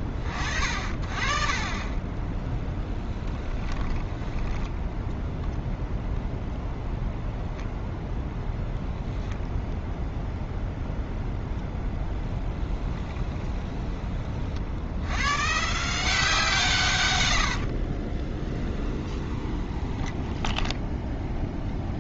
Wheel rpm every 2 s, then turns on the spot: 40, 20, 10, 0, 0, 0, 10, 40, 160, 20, 10.
2-6 12-14 18-22